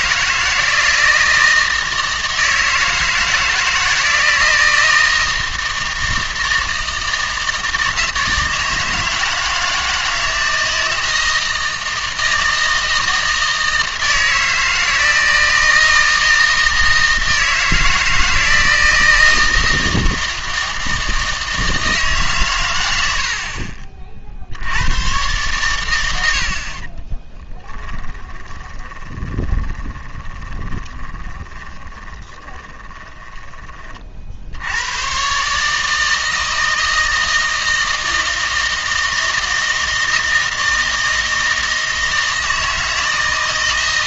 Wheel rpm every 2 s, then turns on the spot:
160, 160, 160, 160, 160, 160, 160, 160, 160, 160, 160, 100, 90, 40, 20, 20, 20, 90, 160, 160, 160, 160.
28-34